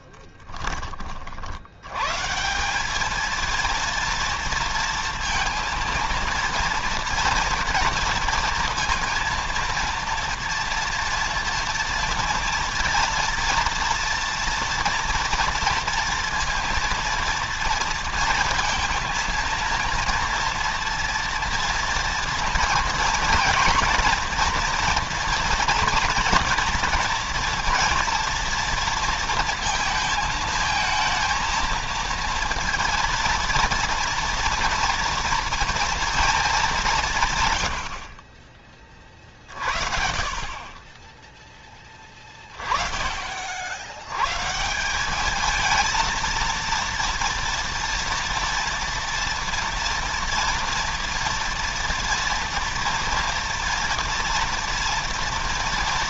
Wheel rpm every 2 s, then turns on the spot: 20, 190, 230, 230, 230, 230, 230, 230, 230, 230, 230, 230, 230, 230, 230, 230, 230, 230, 200, 30, 30, 30, 160, 230, 230, 230, 230, 230.
none